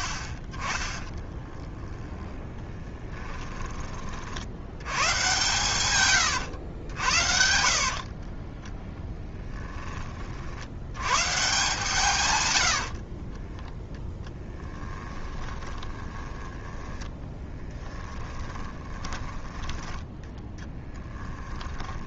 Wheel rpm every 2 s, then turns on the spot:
30, 10, 100, 90, 10, 80, 80, 10, 20, 20, 10.
2-4 6-8 12-20